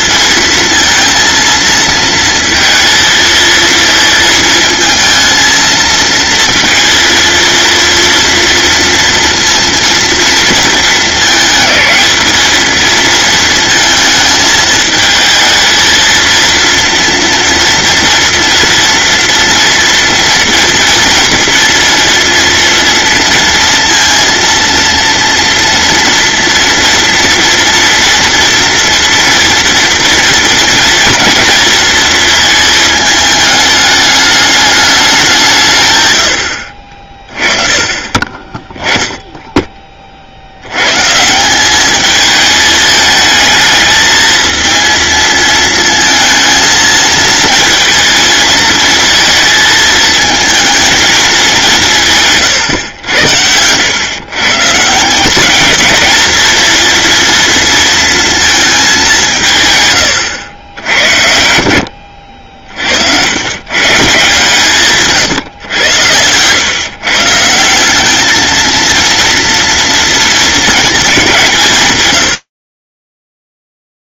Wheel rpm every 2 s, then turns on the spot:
230, 230, 220, 230, 230, 220, 220, 220, 230, 230, 230, 230, 230, 230, 230, 240, 220, 210, 60, 10, 110, 220, 230, 230, 230, 220, 110, 150, 230, 210, 80, 60, 150, 130, 230, 230, 30.
none